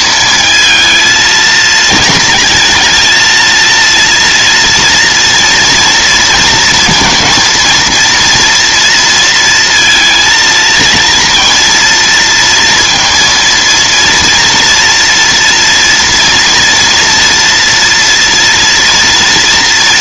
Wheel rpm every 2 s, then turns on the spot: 220, 220, 230, 230, 230, 230, 230, 230, 230, 230.
none